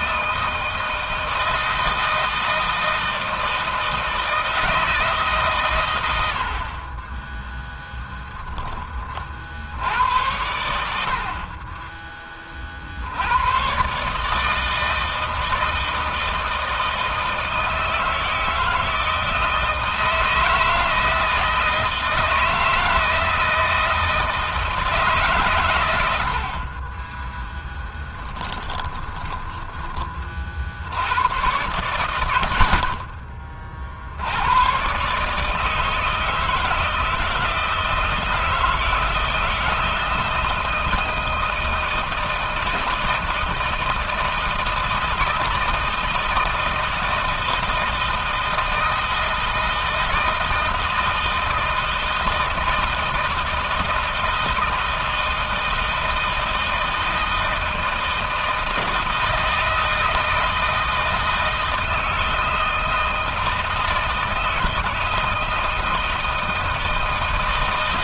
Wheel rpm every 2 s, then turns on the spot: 160, 160, 150, 20, 20, 80, 60, 160, 160, 160, 160, 160, 150, 20, 20, 70, 40, 130, 160, 170, 170, 160, 160, 160, 160, 160, 160, 160, 160, 160, 160, 160, 160, 160.
28-30